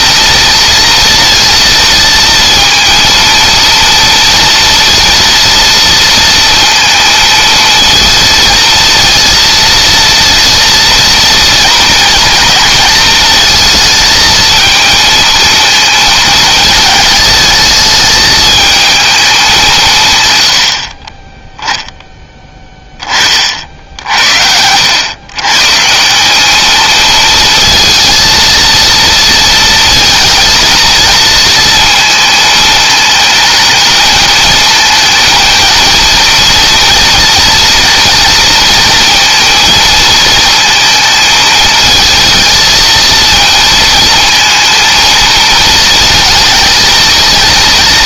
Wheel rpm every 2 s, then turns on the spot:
230, 230, 230, 230, 230, 230, 220, 220, 220, 220, 40, 20, 110, 220, 230, 230, 220, 220, 230, 230, 220, 220, 230, 230.
none